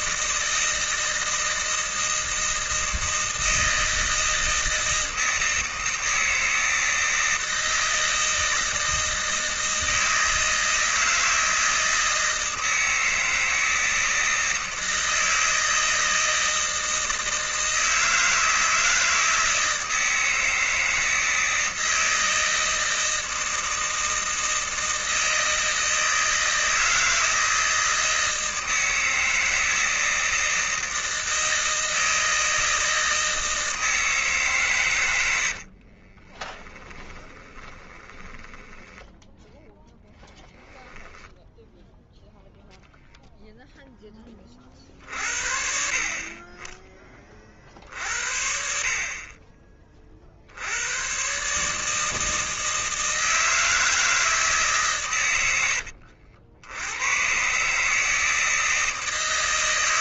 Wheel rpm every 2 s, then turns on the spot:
160, 160, 160, 160, 160, 160, 160, 160, 160, 160, 160, 160, 160, 160, 160, 160, 160, 130, 20, 10, 10, 0, 40, 20, 50, 90, 160, 140, 90, 160.
36-42